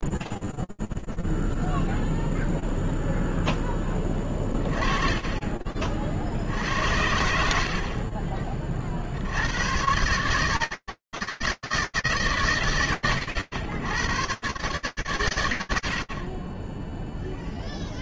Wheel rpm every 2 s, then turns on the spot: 0, 0, 20, 70, 40, 140, 80, 100, 30.
none